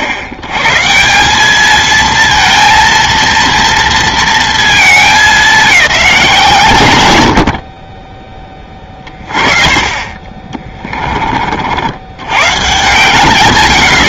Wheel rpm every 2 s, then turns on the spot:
90, 230, 220, 140, 40, 30, 110.
10-12